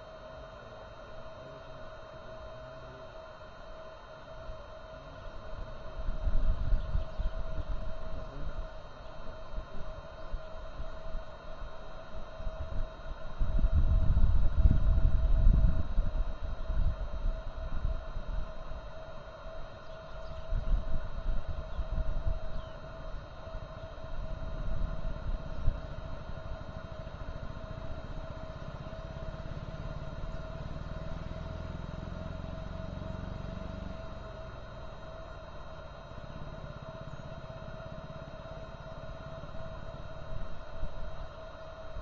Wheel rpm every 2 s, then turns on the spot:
0, 0, 0, 0, 0, 0, 0, 0, 0, 0, 0, 0, 0, 0, 0, 0, 0, 0, 0, 0, 0.
none